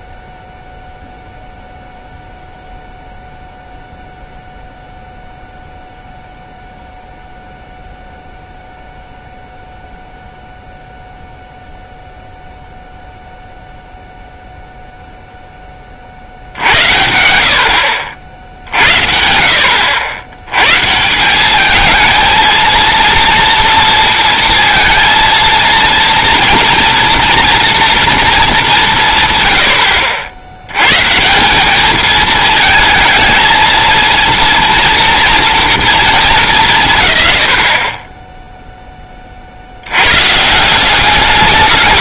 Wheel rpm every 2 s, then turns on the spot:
0, 0, 0, 0, 0, 0, 0, 0, 70, 80, 110, 230, 230, 230, 220, 80, 230, 230, 190, 10, 150.
none